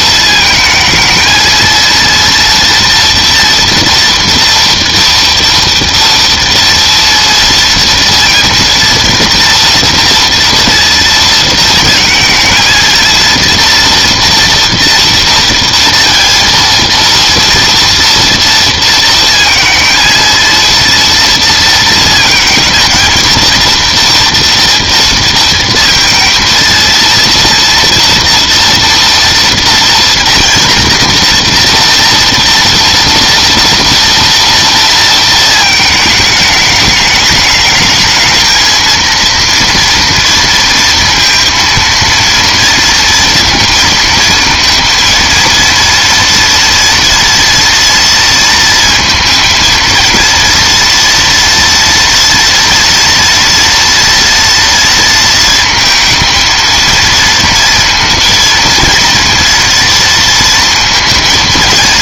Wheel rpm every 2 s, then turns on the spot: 220, 230, 230, 230, 230, 230, 220, 230, 230, 230, 230, 220, 230, 230, 230, 230, 230, 230, 210, 220, 230, 230, 230, 240, 230, 230, 230, 230, 230, 230, 230.
none